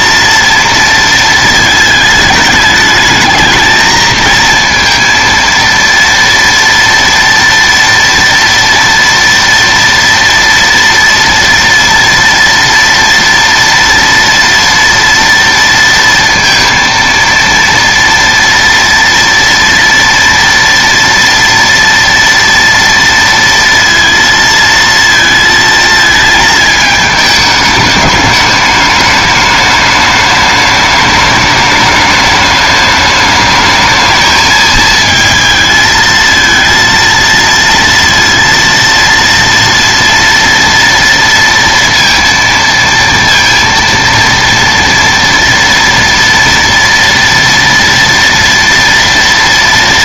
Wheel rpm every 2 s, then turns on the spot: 230, 210, 230, 230, 230, 230, 230, 230, 230, 230, 230, 230, 230, 210, 210, 210, 210, 220, 230, 230, 230, 230, 230, 230, 230.
none